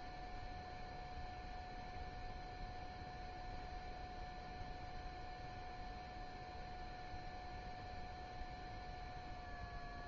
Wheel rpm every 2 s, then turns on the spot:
0, 0, 0, 0, 0.
none